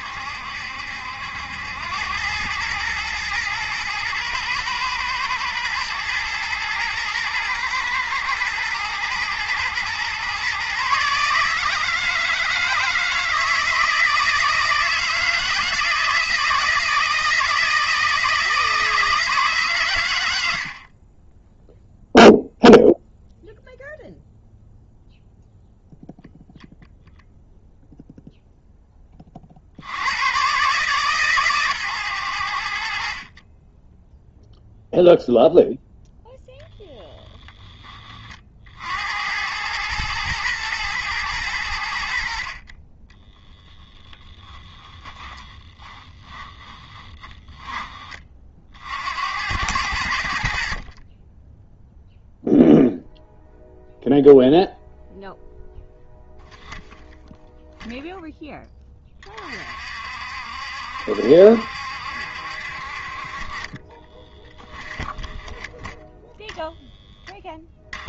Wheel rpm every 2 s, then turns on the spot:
70, 110, 110, 110, 120, 140, 160, 160, 160, 160, 50, 0, 0, 0, 10, 130, 70, 0, 0, 70, 120, 30, 20, 20, 60, 40, 0, 0, 0, 20, 70, 50, 20, 0.
42-48 64-66